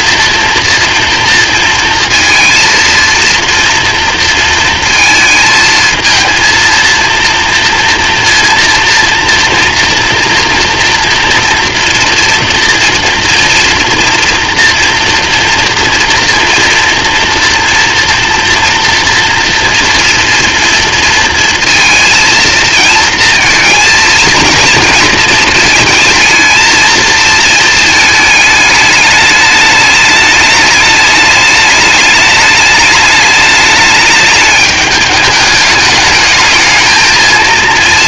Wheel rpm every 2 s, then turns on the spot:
230, 230, 220, 230, 230, 230, 230, 230, 230, 230, 230, 230, 230, 230, 210, 210, 210, 210, 220.
none